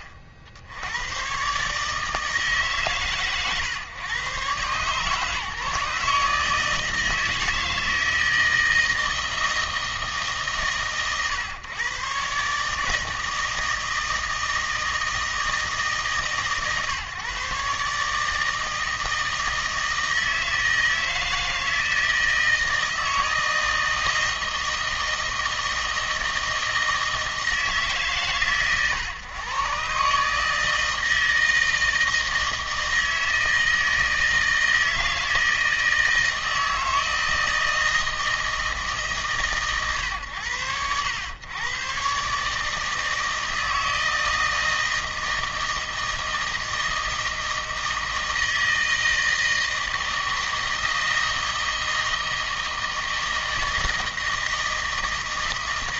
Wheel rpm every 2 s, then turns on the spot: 50, 140, 130, 160, 160, 130, 150, 160, 130, 160, 160, 160, 160, 160, 120, 160, 160, 160, 160, 150, 90, 150, 160, 160, 160, 160, 160, 160.
none